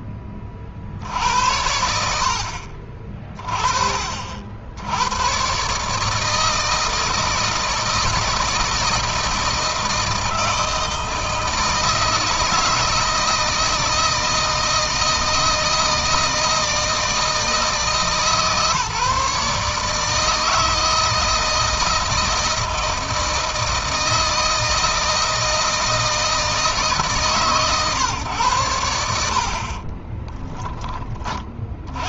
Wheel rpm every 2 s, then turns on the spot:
50, 50, 90, 160, 160, 160, 160, 160, 160, 150, 160, 160, 160, 150, 90, 30.
none